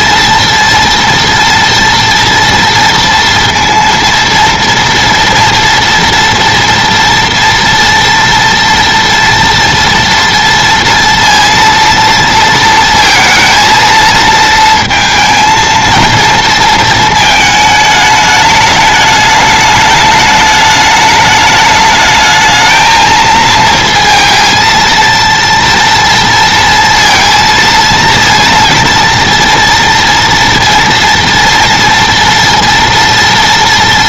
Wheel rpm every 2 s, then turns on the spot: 230, 230, 230, 240, 230, 230, 230, 230, 230, 210, 210, 220, 230, 230, 230, 230, 230.
none